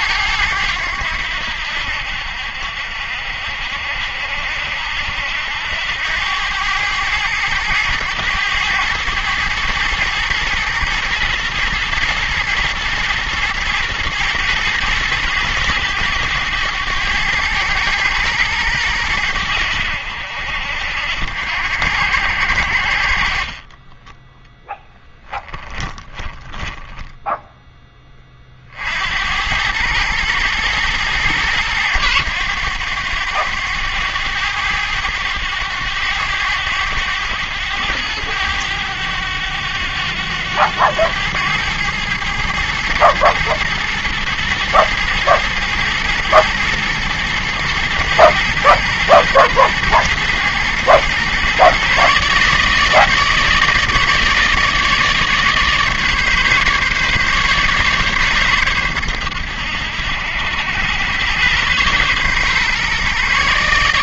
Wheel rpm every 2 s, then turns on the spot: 90, 60, 70, 100, 110, 120, 110, 110, 100, 110, 70, 70, 10, 10, 50, 110, 100, 100, 100, 100, 100, 110, 110, 120, 120, 110, 150, 160, 150, 120, 90, 130.
24-28